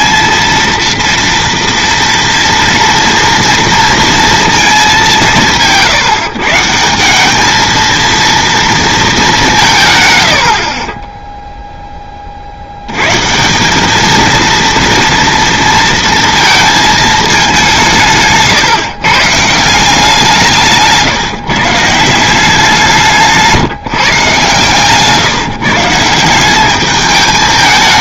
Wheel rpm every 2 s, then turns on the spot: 230, 230, 180, 180, 220, 10, 120, 230, 220, 130, 150, 170, 130, 210.
10-12